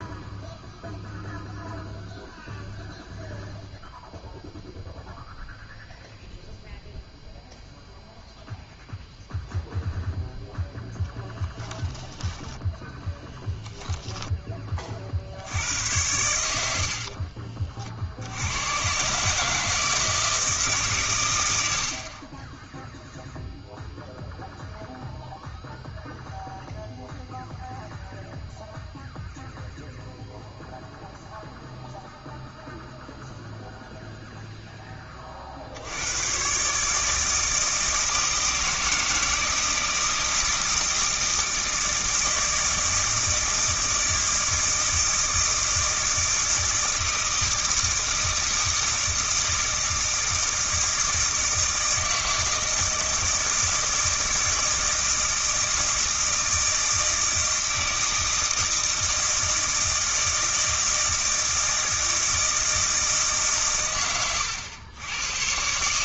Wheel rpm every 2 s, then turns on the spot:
0, 0, 0, 0, 0, 0, 10, 20, 80, 100, 150, 10, 0, 0, 0, 0, 0, 0, 140, 160, 160, 160, 160, 160, 160, 160, 160, 160, 160, 160, 160, 160, 110.
none